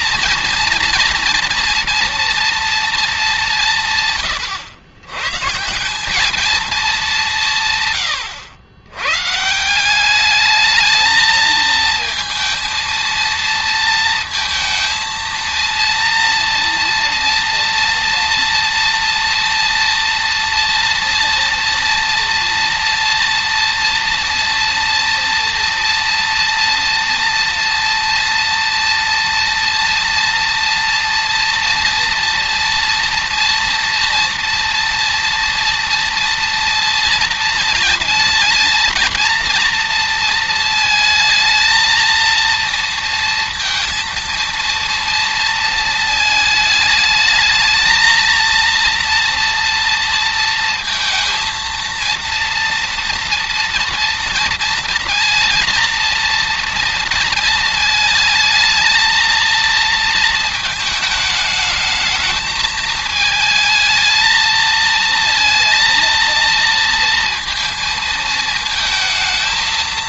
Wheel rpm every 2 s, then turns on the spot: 230, 230, 120, 210, 110, 220, 230, 230, 230, 230, 230, 230, 230, 230, 230, 230, 240, 230, 230, 230, 220, 230, 230, 220, 230, 230, 230, 230, 230, 220, 220, 220, 230, 230, 220.
none